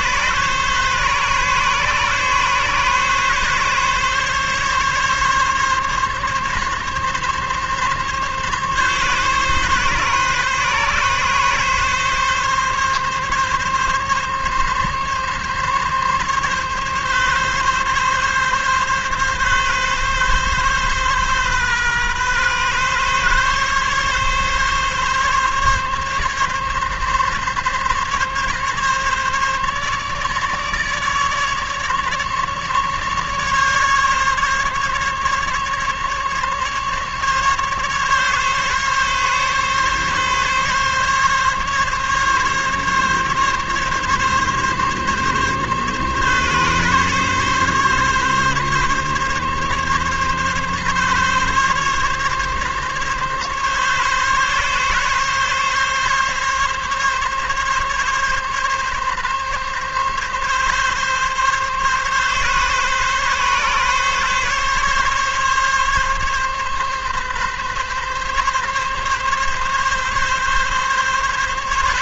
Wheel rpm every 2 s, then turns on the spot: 140, 140, 140, 140, 140, 140, 140, 140, 140, 140, 130, 130, 140, 140, 140, 150, 150, 140, 140, 140, 140, 140, 140, 140, 140, 140, 140, 140, 140, 140, 140, 140, 140, 140, 140, 140.
none